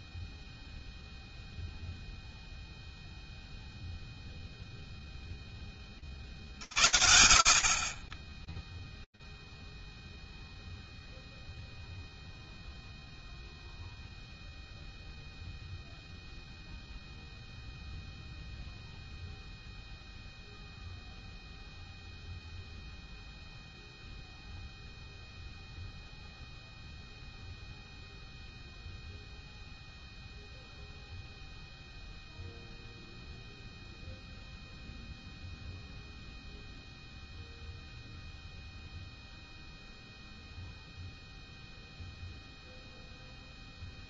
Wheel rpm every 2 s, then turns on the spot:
0, 0, 0, 70, 0, 0, 0, 0, 0, 0, 0, 0, 0, 0, 0, 0, 0, 0, 0, 0, 0, 0.
none